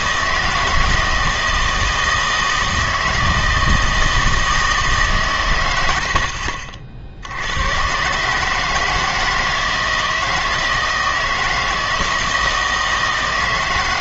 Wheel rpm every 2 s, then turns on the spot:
160, 160, 160, 50, 160, 160, 160.
none